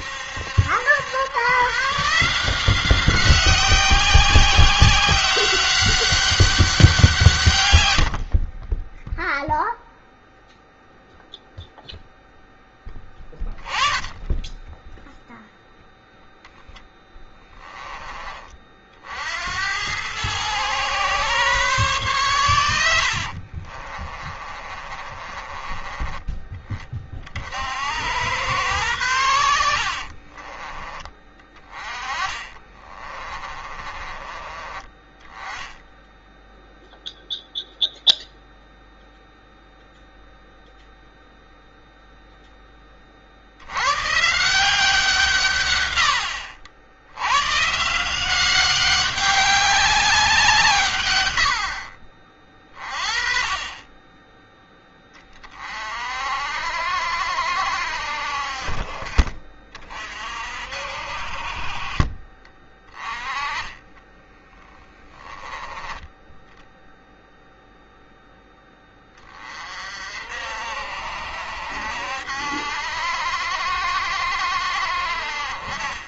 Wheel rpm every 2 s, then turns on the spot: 80, 170, 190, 190, 40, 0, 0, 10, 10, 40, 120, 100, 40, 20, 100, 40, 30, 30, 0, 0, 0, 10, 160, 70, 190, 170, 40, 20, 60, 50, 50, 30, 20, 10, 10, 60, 70, 60.
8-10 16-18 24-26 30-34 64-66